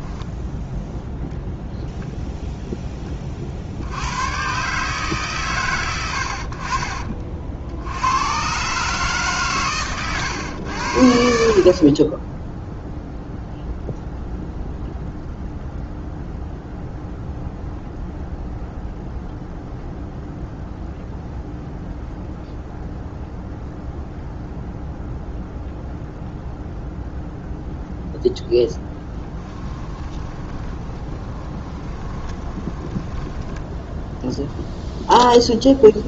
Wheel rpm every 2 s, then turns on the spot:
0, 10, 140, 40, 150, 80, 0, 0, 0, 0, 0, 0, 0, 0, 10, 40, 10, 0.
28-34